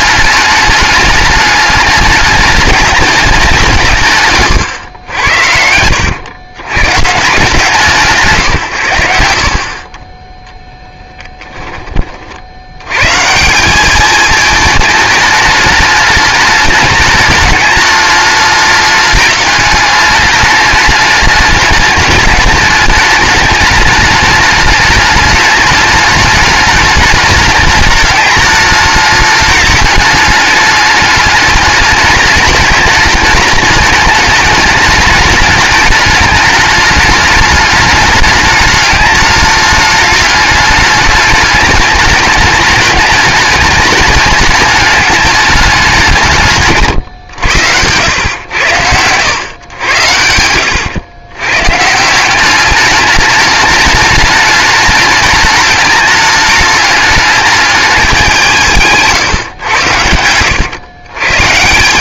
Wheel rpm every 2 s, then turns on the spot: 210, 210, 120, 110, 120, 10, 90, 220, 210, 210, 210, 210, 210, 210, 210, 210, 210, 210, 200, 210, 210, 210, 210, 150, 100, 90, 200, 210, 210, 170, 110.
4-6 10-12 50-52